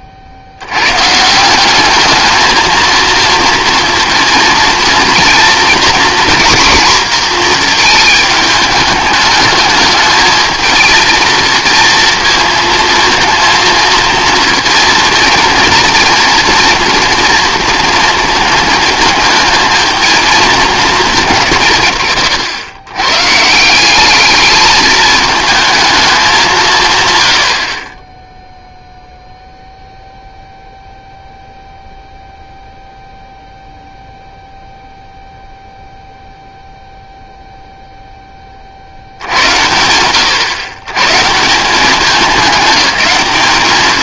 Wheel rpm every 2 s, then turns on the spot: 110, 230, 230, 240, 210, 220, 230, 230, 240, 230, 200, 100, 220, 140, 0, 0, 0, 0, 0, 40, 120, 210.
none